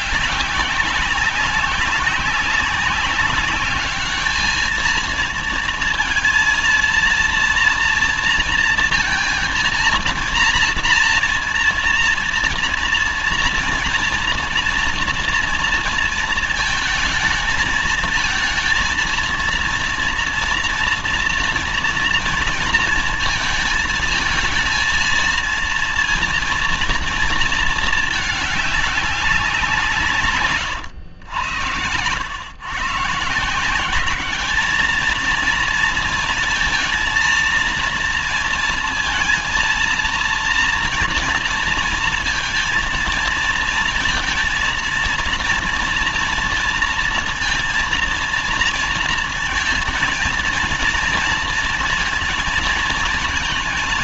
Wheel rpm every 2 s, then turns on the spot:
190, 200, 220, 230, 230, 230, 230, 240, 220, 230, 230, 230, 230, 230, 200, 110, 150, 220, 230, 220, 230, 220, 230, 230, 230, 230, 230.
none